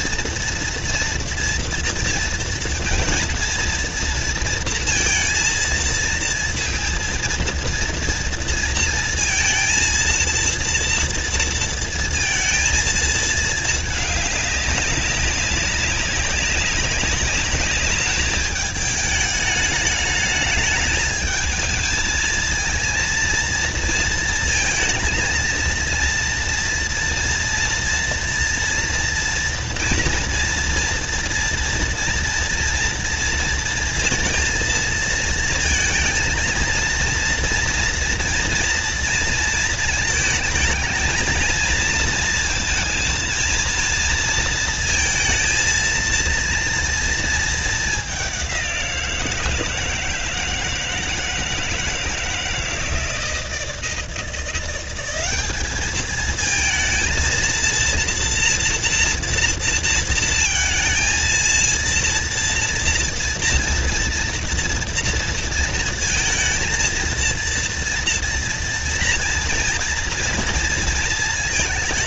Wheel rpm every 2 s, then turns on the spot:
230, 230, 230, 230, 230, 230, 220, 200, 200, 210, 210, 230, 230, 230, 240, 230, 230, 230, 230, 230, 220, 230, 230, 230, 170, 160, 160, 190, 230, 230, 230, 230, 230, 230, 230, 230.
none